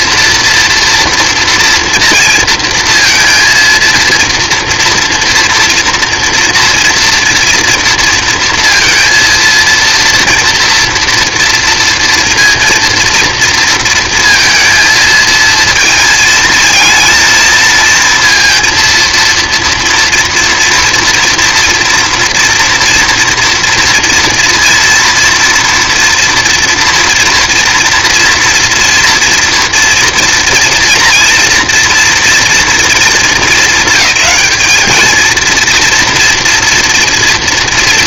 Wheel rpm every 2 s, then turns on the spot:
230, 230, 230, 230, 230, 240, 230, 230, 230, 230, 230, 230, 230, 230, 230, 230, 220, 210, 230.
none